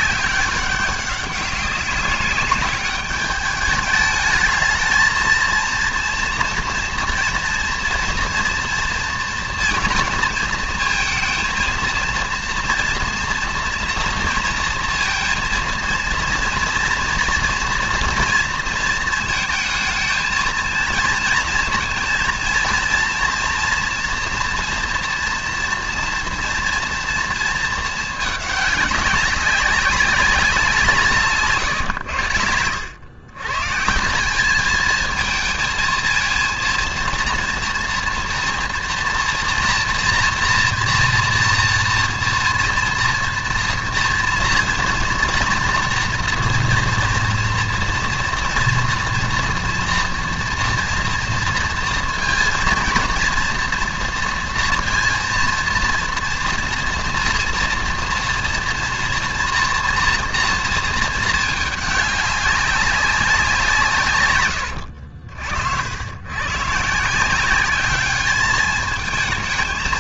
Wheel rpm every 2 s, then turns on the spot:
190, 210, 220, 230, 230, 220, 230, 230, 230, 230, 230, 230, 230, 230, 200, 180, 100, 220, 230, 230, 230, 230, 230, 240, 240, 230, 230, 230, 230, 230, 230, 200, 100, 150, 210.
none